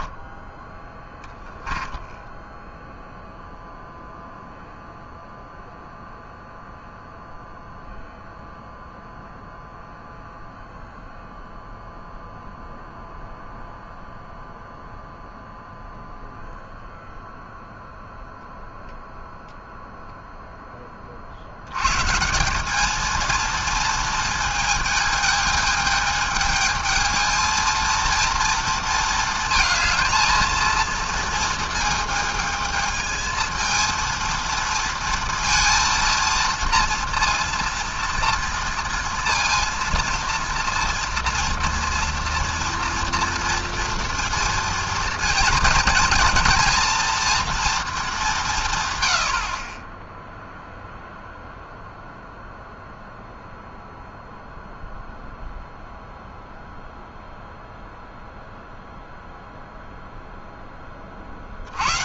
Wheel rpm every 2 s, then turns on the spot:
10, 0, 0, 0, 0, 0, 0, 0, 0, 0, 20, 210, 220, 220, 230, 230, 220, 230, 230, 230, 230, 230, 230, 240, 130, 0, 0, 0, 0, 0, 20.
none